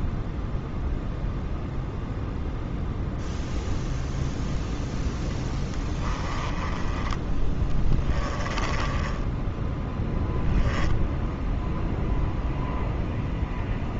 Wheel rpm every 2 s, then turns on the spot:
0, 0, 0, 10, 20, 0, 0.
8-10